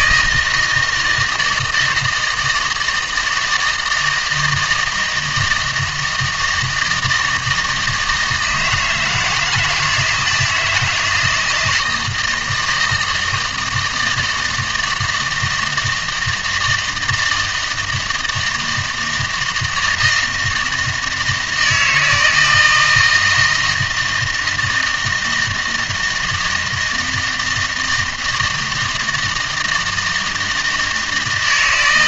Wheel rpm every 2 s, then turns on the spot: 160, 160, 160, 160, 160, 170, 160, 160, 160, 160, 160, 160, 160, 160, 160, 160.
none